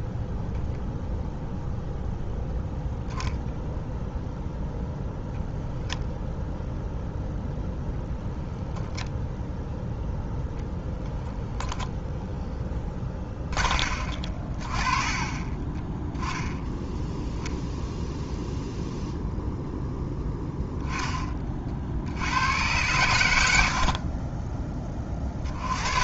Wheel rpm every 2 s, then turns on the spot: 0, 0, 0, 0, 0, 0, 10, 30, 10, 0, 10, 100, 10.
none